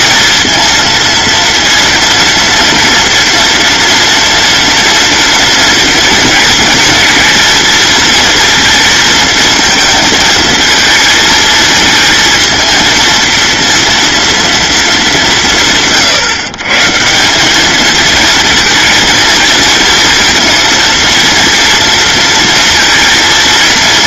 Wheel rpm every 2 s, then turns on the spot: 230, 230, 230, 230, 230, 230, 230, 220, 150, 230, 230, 230.
none